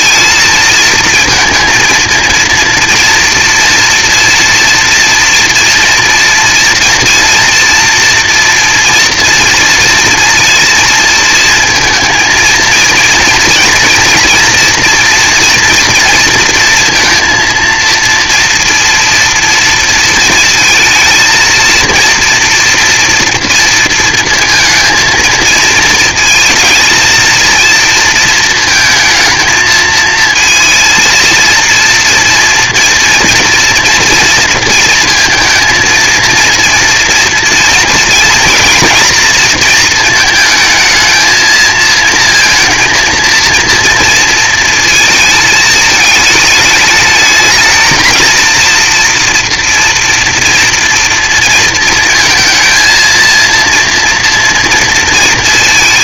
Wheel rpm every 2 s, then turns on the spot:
230, 230, 230, 230, 240, 230, 230, 230, 230, 230, 220, 230, 220, 220, 220, 230, 230, 230, 230, 230, 220, 230, 230, 210, 230, 230, 230, 230.
none